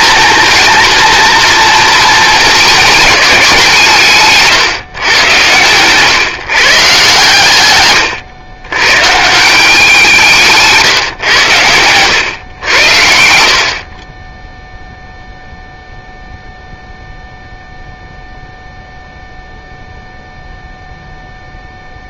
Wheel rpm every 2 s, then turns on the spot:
230, 220, 130, 140, 120, 140, 100, 0, 0, 0, 0.
none